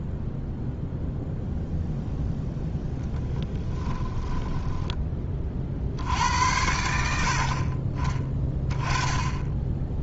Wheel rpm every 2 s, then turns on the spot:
0, 10, 10, 80, 10.
4-6